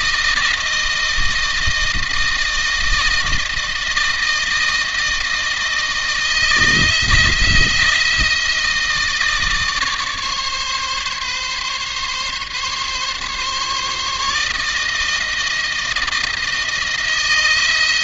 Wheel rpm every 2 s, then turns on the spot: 160, 160, 160, 160, 160, 140, 140, 150, 170.
none